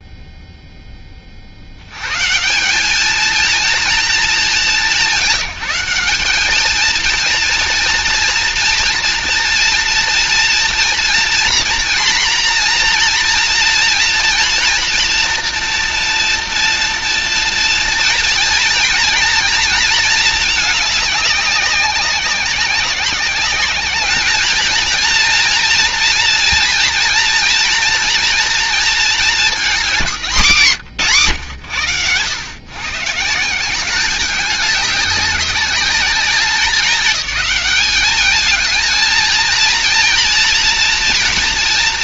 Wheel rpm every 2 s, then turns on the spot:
30, 210, 160, 230, 230, 240, 240, 230, 230, 230, 200, 190, 230, 230, 230, 140, 150, 200, 200, 230, 240.
none